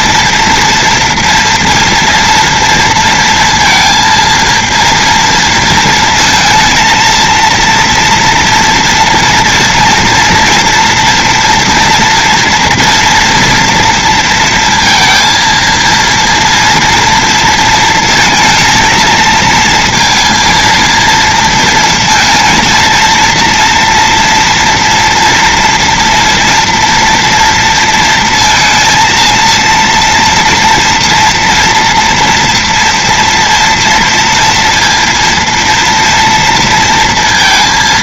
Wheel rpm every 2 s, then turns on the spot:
230, 230, 230, 230, 230, 230, 240, 230, 230, 230, 230, 230, 230, 230, 230, 230, 230, 230, 230.
none